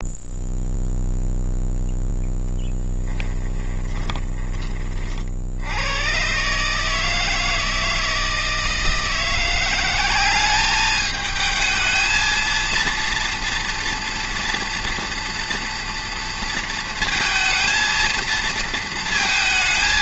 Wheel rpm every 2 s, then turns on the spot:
0, 10, 20, 140, 160, 200, 230, 230, 230, 230.
2-4